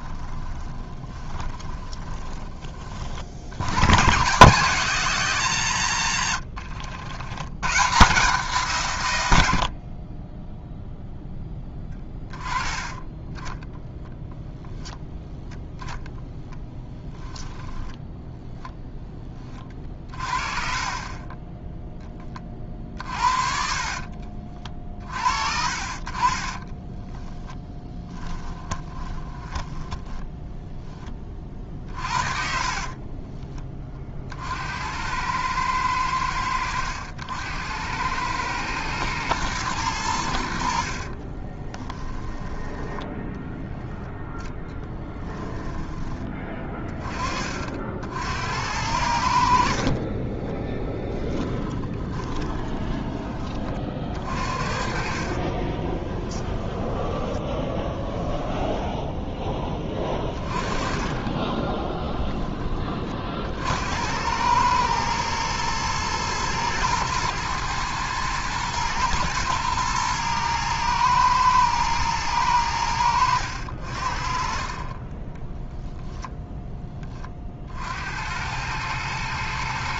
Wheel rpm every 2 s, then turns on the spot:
20, 70, 160, 90, 100, 0, 10, 0, 10, 10, 30, 50, 50, 10, 10, 10, 30, 80, 80, 110, 60, 10, 10, 20, 80, 10, 20, 40, 20, 10, 20, 10, 100, 120, 110, 110, 100, 40, 0, 90.
0-2 22-24 26-30 32-34 40-46 52-58